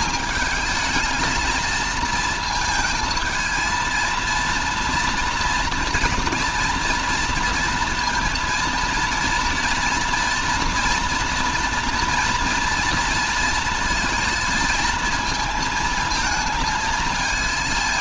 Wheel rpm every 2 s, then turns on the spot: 220, 220, 230, 230, 230, 230, 230, 220, 220.
none